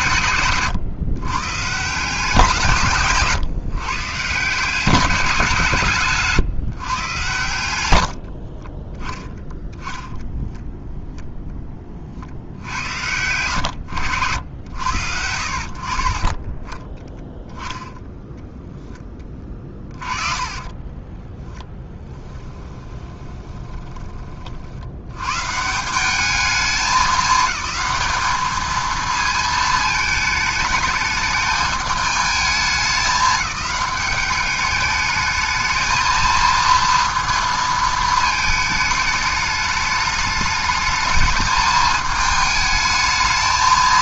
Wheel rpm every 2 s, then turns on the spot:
130, 160, 170, 160, 40, 0, 70, 90, 20, 10, 30, 10, 50, 210, 220, 220, 210, 210, 230, 220, 220, 220.
0-2 8-10 20-24